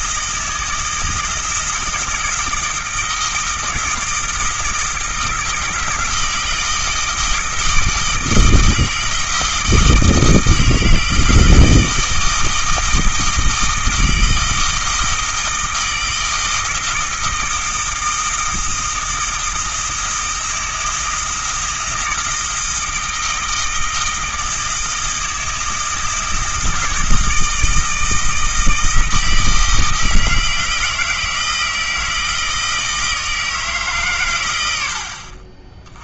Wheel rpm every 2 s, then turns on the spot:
160, 160, 160, 160, 160, 160, 160, 160, 160, 160, 160, 160, 160, 160, 160, 160, 160, 80.
none